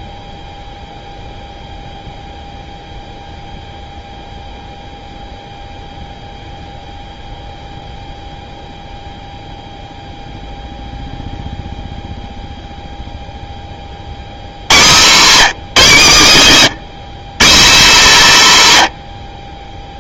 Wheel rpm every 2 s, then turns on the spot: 0, 0, 0, 0, 0, 0, 0, 110, 170, 170.
none